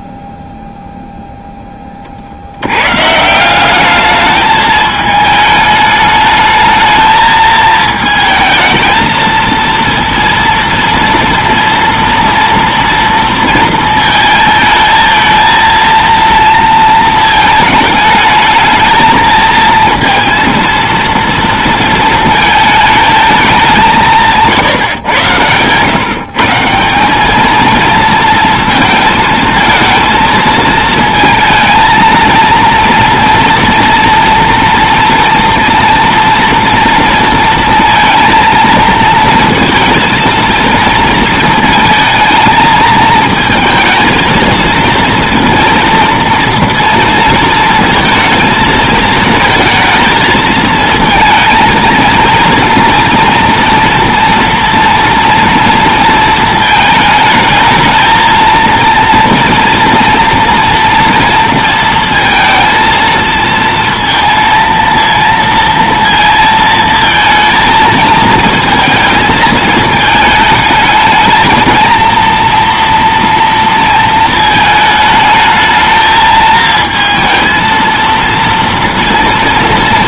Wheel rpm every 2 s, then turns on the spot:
0, 80, 210, 220, 220, 230, 230, 220, 230, 220, 230, 220, 160, 170, 230, 220, 230, 230, 230, 230, 230, 220, 220, 230, 220, 220, 230, 230, 220, 230, 230, 230, 230, 230, 230, 220, 240, 220, 220, 230.
24-26